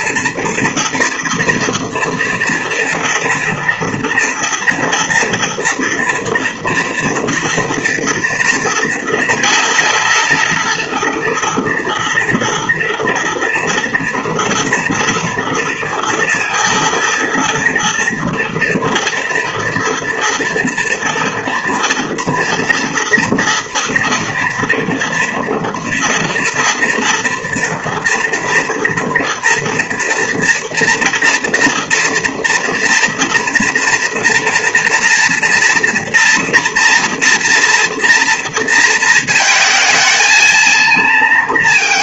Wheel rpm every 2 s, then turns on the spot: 230, 230, 230, 230, 230, 230, 230, 230, 230, 230, 230, 230, 230, 240, 240, 240, 230, 230, 230, 230, 230.
none